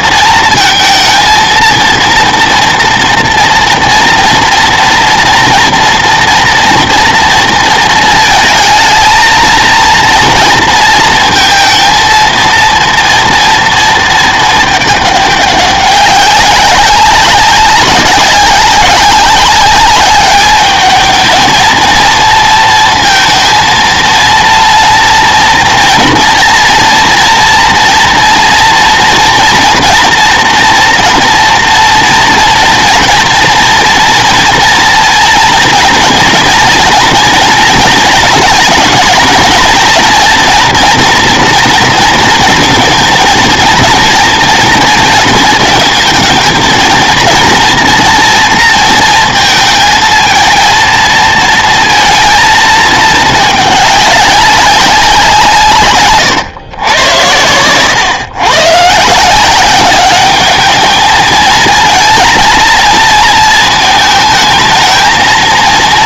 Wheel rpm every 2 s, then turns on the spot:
230, 230, 240, 240, 220, 220, 230, 210, 190, 190, 210, 230, 230, 230, 230, 230, 230, 230, 230, 230, 230, 230, 230, 220, 230, 230, 220, 190, 110, 120, 210, 220, 220.
none